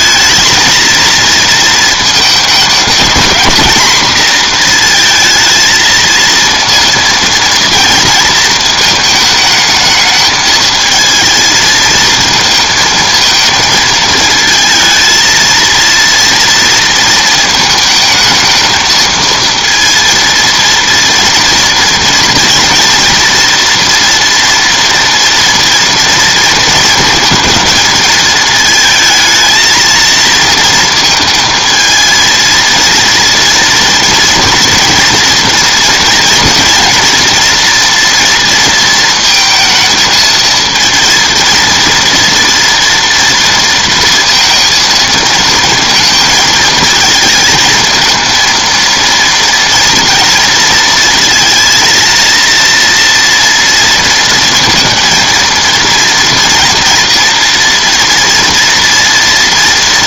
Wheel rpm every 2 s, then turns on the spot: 230, 210, 230, 230, 220, 220, 230, 220, 230, 220, 230, 230, 230, 220, 220, 230, 230, 230, 240, 230, 220, 230, 230, 220, 230, 230, 230, 230, 240, 230.
none